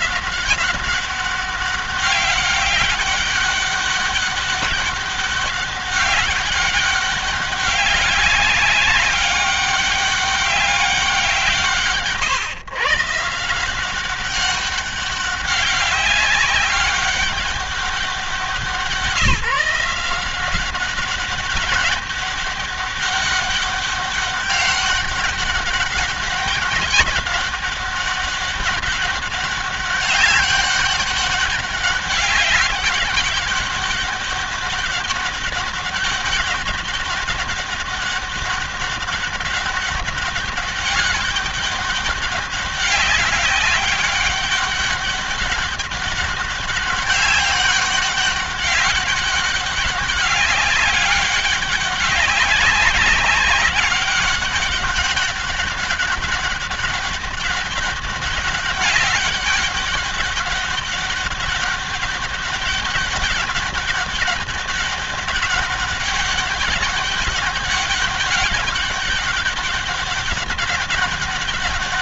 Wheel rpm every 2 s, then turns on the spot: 190, 200, 200, 200, 200, 190, 130, 200, 190, 170, 190, 200, 200, 200, 200, 200, 200, 200, 190, 200, 200, 200, 200, 200, 200, 190, 190, 200, 200, 200, 200, 200, 200, 200, 200, 200.
none